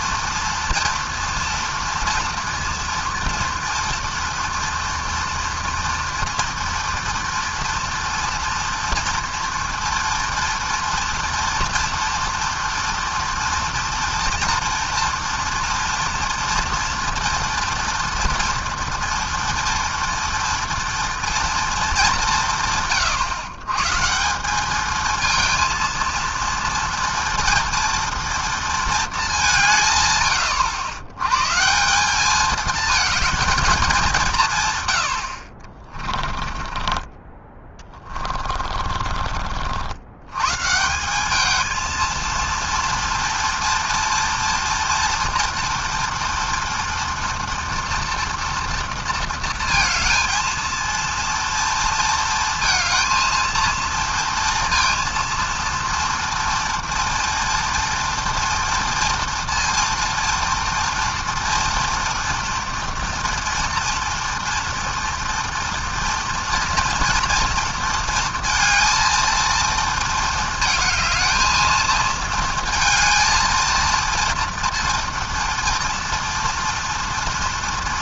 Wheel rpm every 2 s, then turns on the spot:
230, 230, 230, 230, 240, 240, 230, 230, 230, 230, 230, 120, 230, 230, 200, 120, 220, 60, 20, 40, 200, 230, 230, 240, 230, 230, 230, 230, 230, 230, 240, 230, 230, 230, 230, 220, 230, 230, 230.
34-36 38-40